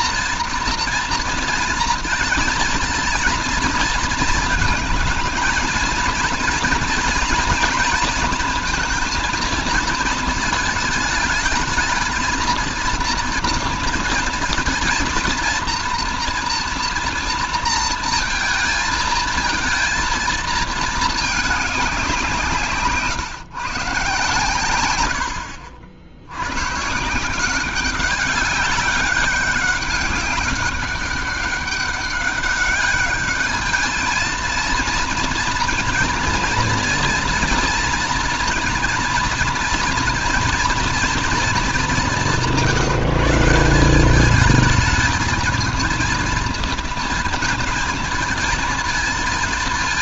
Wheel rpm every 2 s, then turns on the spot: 230, 230, 220, 230, 230, 220, 220, 220, 230, 230, 220, 160, 110, 110, 200, 190, 200, 230, 230, 230, 230, 170, 210, 230, 220.
none